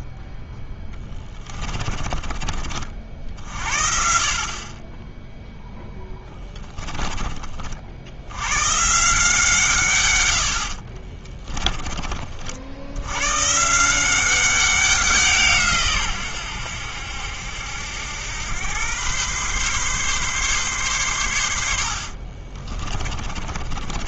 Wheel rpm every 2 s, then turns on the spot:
10, 40, 30, 10, 120, 60, 70, 190, 90, 110, 130, 40.
0-2 10-12 22-24